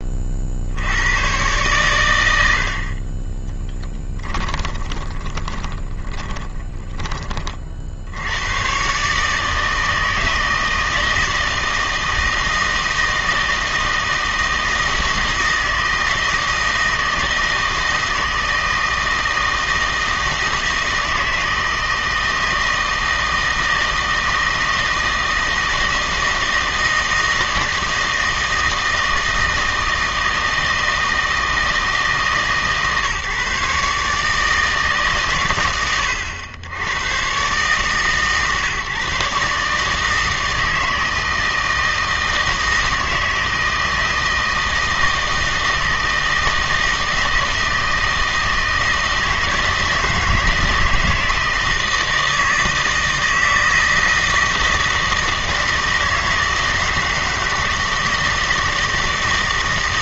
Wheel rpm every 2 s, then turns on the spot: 70, 60, 20, 10, 120, 160, 160, 160, 160, 160, 160, 160, 160, 160, 160, 160, 150, 150, 90, 140, 160, 160, 160, 160, 160, 160, 160, 160, 160, 160.
4-8